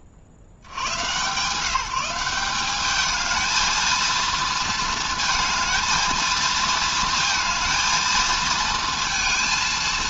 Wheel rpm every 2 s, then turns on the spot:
100, 200, 230, 230, 230.
none